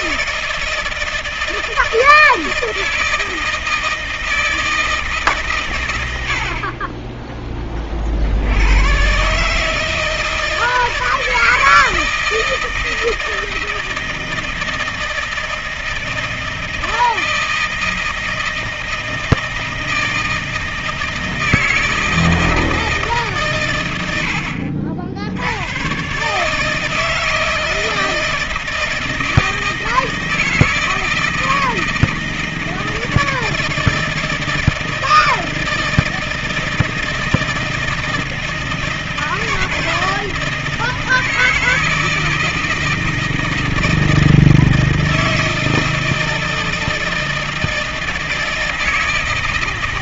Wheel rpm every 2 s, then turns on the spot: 160, 160, 160, 60, 80, 160, 160, 160, 160, 160, 160, 160, 70, 150, 160, 160, 160, 160, 160, 160, 170, 160, 160, 160, 160.
none